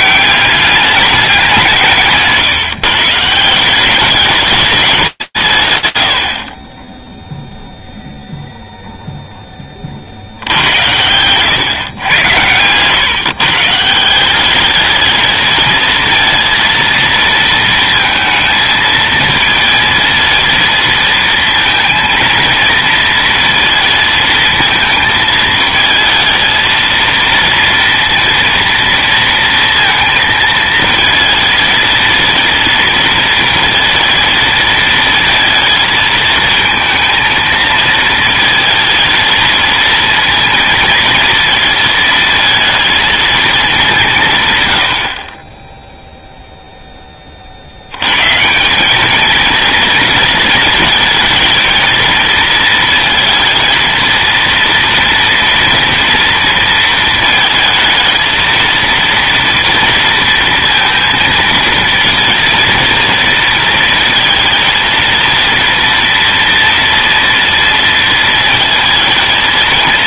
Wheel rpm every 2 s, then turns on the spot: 200, 150, 210, 90, 0, 80, 110, 210, 230, 220, 230, 230, 220, 220, 230, 230, 230, 230, 220, 230, 230, 220, 120, 10, 210, 230, 220, 230, 230, 230, 230, 230, 230, 230, 230.
none